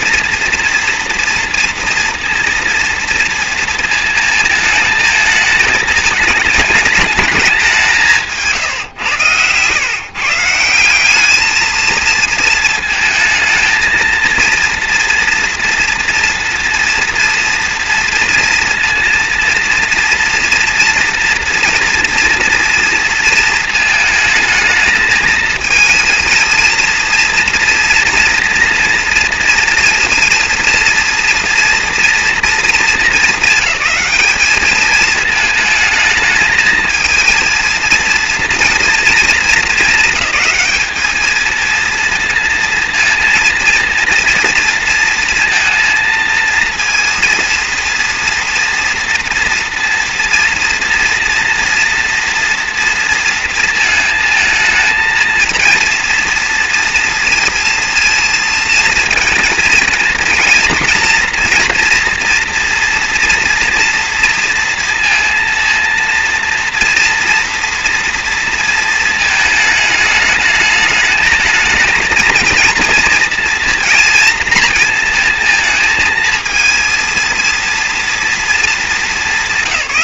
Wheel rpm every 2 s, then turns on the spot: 240, 230, 220, 220, 150, 170, 220, 230, 230, 230, 240, 230, 220, 220, 230, 230, 230, 220, 220, 230, 210, 230, 230, 230, 240, 230, 230, 220, 230, 230, 230, 230, 230, 230, 230, 210, 230, 230, 220, 220.
none